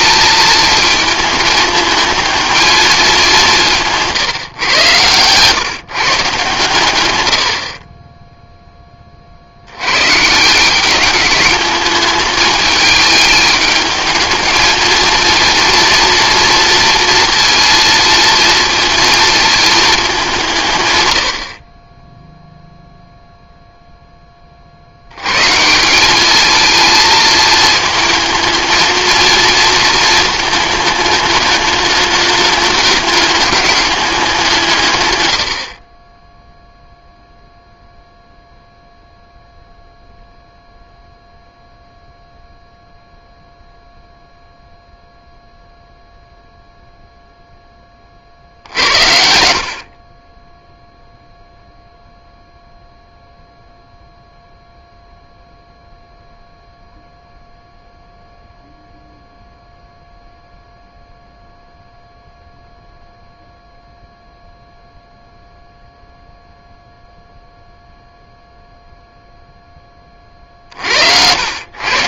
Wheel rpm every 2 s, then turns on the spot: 220, 210, 120, 120, 10, 190, 210, 220, 230, 230, 130, 0, 70, 220, 220, 220, 210, 130, 0, 0, 0, 0, 0, 0, 70, 0, 0, 0, 0, 0, 0, 0, 0, 0, 0, 60.
none